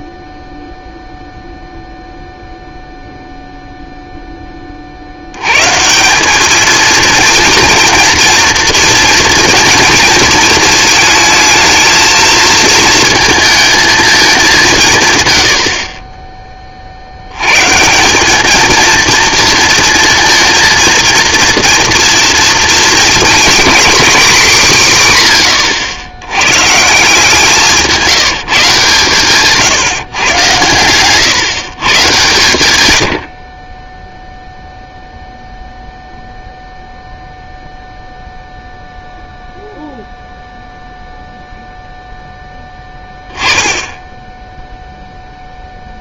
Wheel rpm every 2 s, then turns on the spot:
0, 0, 30, 230, 240, 220, 230, 180, 30, 220, 230, 230, 190, 160, 150, 120, 110, 0, 0, 0, 0, 10, 0.
none